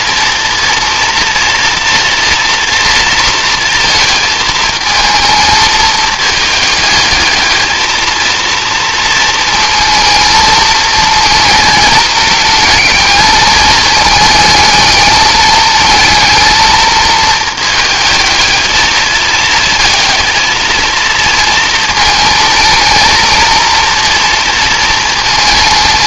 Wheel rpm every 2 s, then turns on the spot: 230, 230, 220, 210, 230, 220, 220, 220, 220, 220, 230, 220, 230.
none